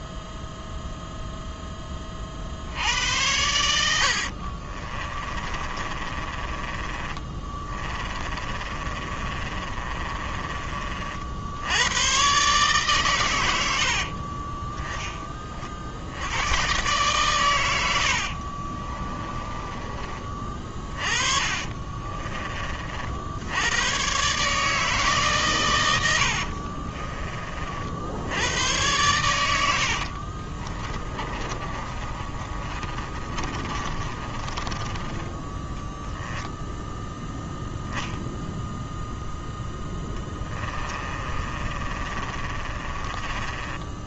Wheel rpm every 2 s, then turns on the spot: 0, 90, 30, 20, 30, 40, 130, 10, 130, 30, 30, 50, 150, 30, 100, 20, 30, 20, 0, 0, 20, 30.
4-10 18-22 26-28 30-36 40-44